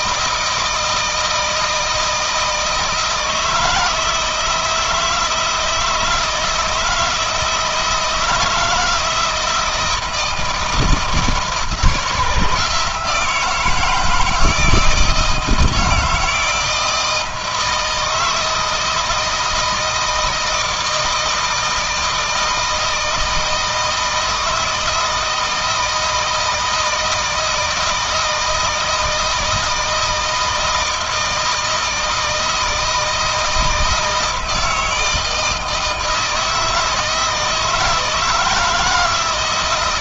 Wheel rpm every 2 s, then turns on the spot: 160, 160, 160, 170, 160, 160, 160, 160, 160, 160, 160, 160, 160, 160, 160, 160, 160, 160, 160, 160.
none